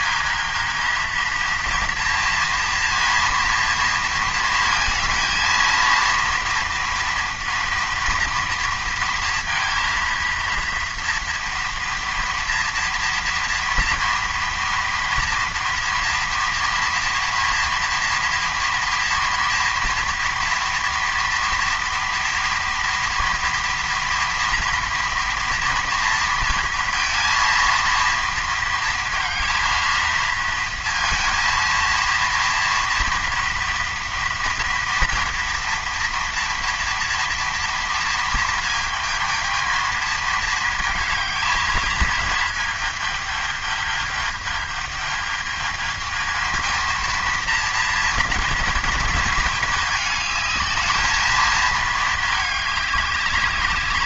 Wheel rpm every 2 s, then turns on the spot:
230, 230, 230, 230, 230, 240, 240, 240, 230, 240, 230, 230, 230, 230, 230, 230, 230, 230, 230, 220, 220, 210, 210, 230, 230, 220, 200.
none